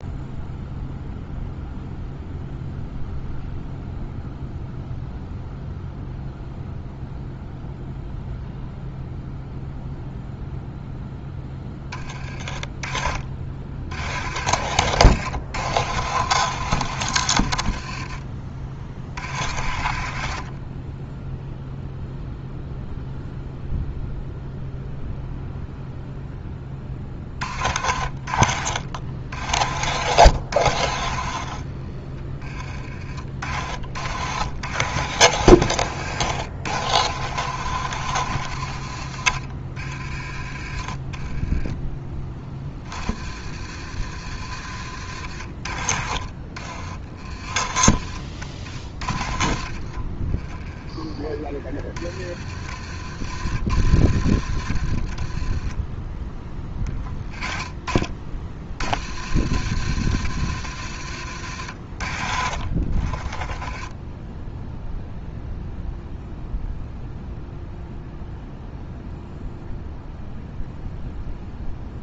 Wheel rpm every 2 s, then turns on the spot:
0, 0, 0, 0, 0, 0, 30, 90, 100, 50, 30, 0, 0, 20, 60, 60, 30, 80, 80, 70, 30, 50, 60, 40, 40, 10, 50, 50, 20, 60, 80, 40, 0, 0, 0, 0.
26-28 44-46 60-62